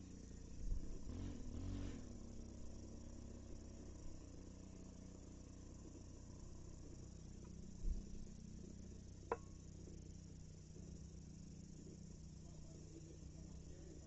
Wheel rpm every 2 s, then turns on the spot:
0, 0, 0, 0, 0, 0, 0.
none